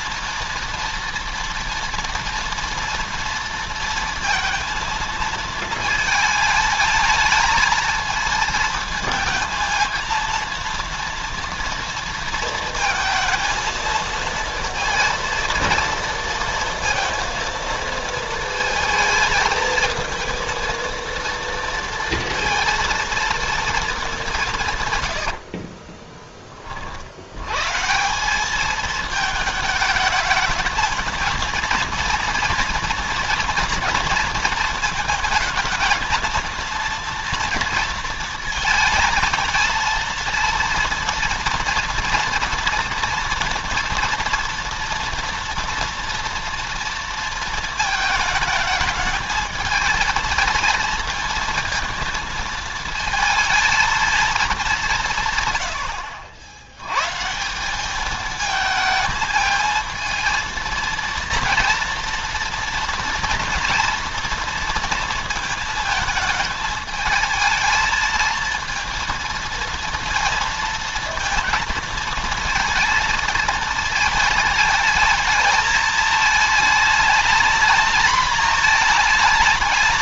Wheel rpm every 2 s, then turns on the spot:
230, 240, 230, 220, 230, 230, 230, 230, 230, 220, 230, 230, 170, 30, 200, 220, 230, 230, 230, 230, 230, 230, 230, 230, 220, 230, 230, 190, 90, 220, 230, 230, 230, 220, 230, 220, 230, 220, 220, 230.
24-26